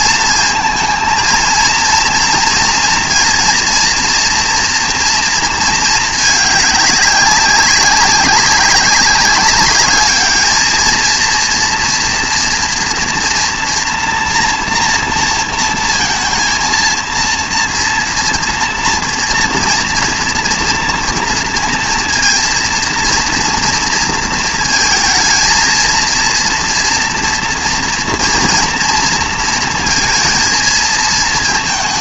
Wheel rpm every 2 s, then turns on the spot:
230, 230, 230, 210, 200, 220, 230, 230, 230, 230, 230, 230, 220, 230, 230, 220.
none